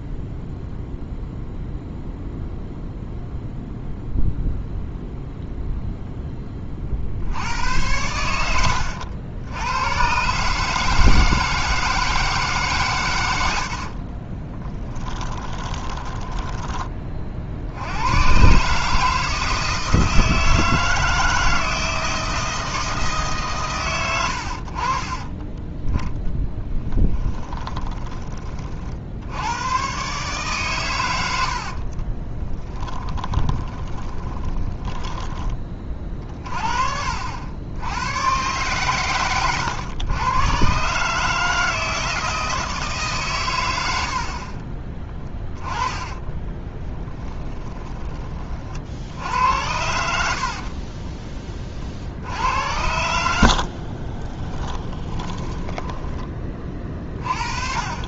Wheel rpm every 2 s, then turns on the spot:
0, 0, 0, 50, 80, 150, 120, 20, 20, 150, 160, 160, 40, 10, 60, 120, 20, 10, 60, 120, 130, 150, 30, 10, 60, 20, 90, 10, 30.
14-16 26-28 32-36 44-48 50-52 54-56